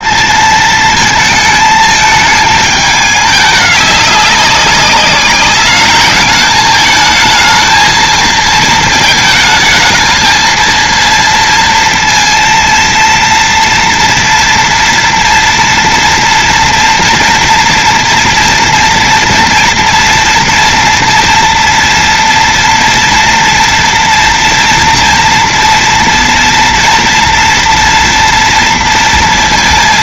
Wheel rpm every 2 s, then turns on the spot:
220, 220, 200, 210, 230, 230, 230, 230, 230, 230, 230, 230, 230, 230, 230.
none